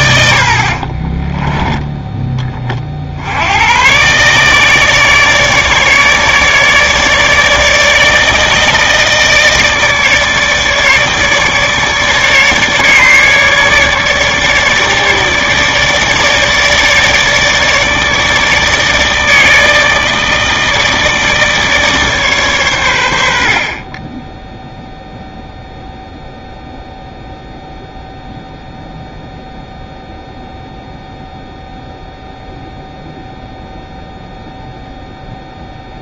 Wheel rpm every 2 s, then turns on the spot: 50, 30, 150, 150, 160, 150, 150, 150, 150, 150, 160, 110, 0, 0, 0, 0, 0, 0.
0-2